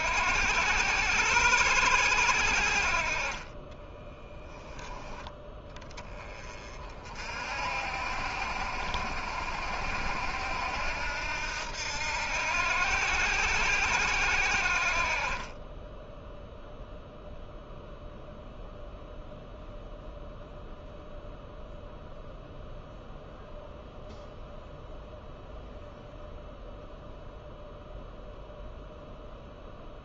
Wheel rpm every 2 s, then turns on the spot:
80, 50, 10, 40, 70, 80, 80, 60, 0, 0, 0, 0, 0, 0, 0.
none